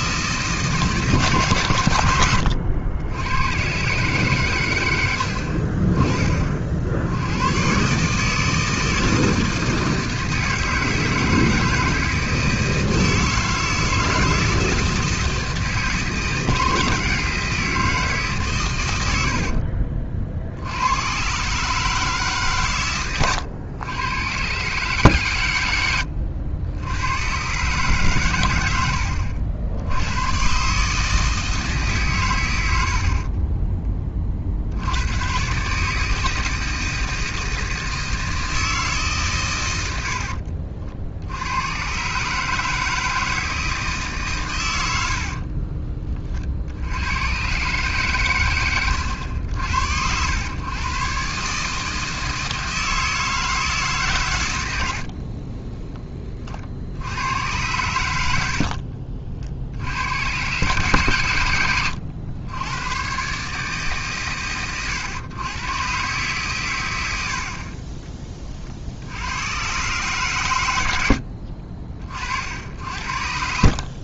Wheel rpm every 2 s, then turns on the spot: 160, 90, 110, 50, 160, 160, 160, 160, 160, 120, 60, 140, 130, 80, 100, 130, 100, 70, 160, 160, 70, 150, 110, 60, 100, 120, 160, 100, 40, 60, 120, 100, 120, 120, 40, 100, 70.
48-50 58-60